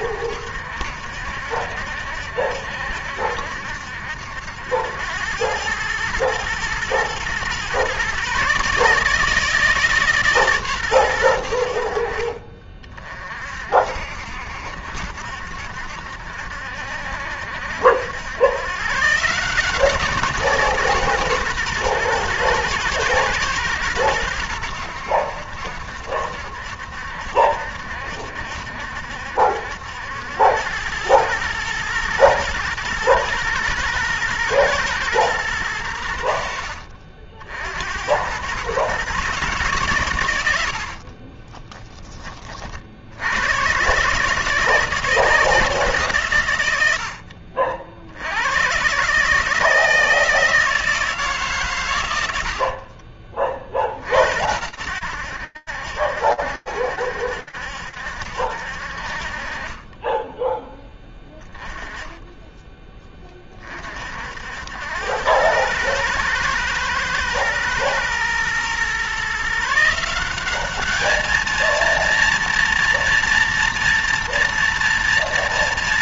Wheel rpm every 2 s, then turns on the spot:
70, 70, 80, 110, 140, 140, 40, 70, 70, 120, 170, 120, 90, 70, 70, 90, 110, 120, 60, 110, 90, 30, 160, 120, 100, 160, 70, 80, 70, 60, 10, 10, 80, 120, 120, 210, 230, 230.
52-54